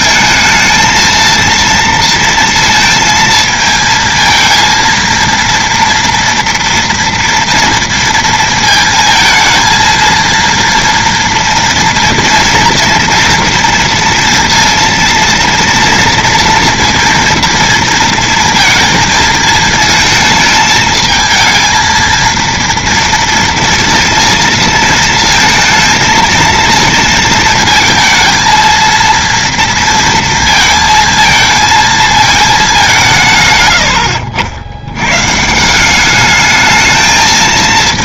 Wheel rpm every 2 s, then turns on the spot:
220, 230, 230, 230, 220, 230, 230, 230, 230, 230, 220, 230, 230, 230, 220, 230, 210, 90, 220.
none